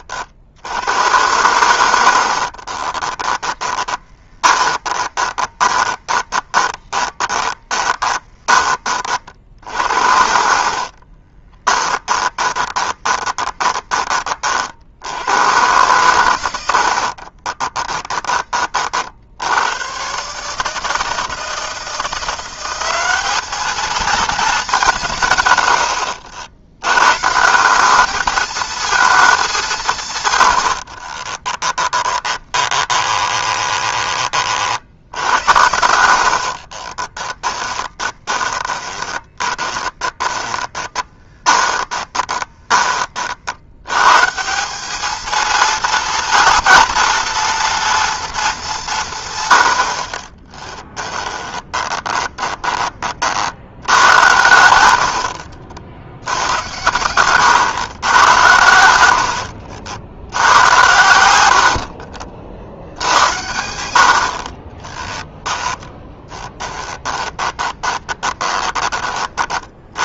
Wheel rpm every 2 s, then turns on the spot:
80, 30, 20, 20, 30, 40, 20, 60, 70, 40, 160, 190, 190, 100, 220, 70, 20, 70, 30, 20, 20, 20, 200, 230, 180, 10, 20, 80, 100, 90, 100, 70, 30, 10, 20.
2-8 10-14 16-18 30-34 36-42 50-52 54-56 58-60 66-68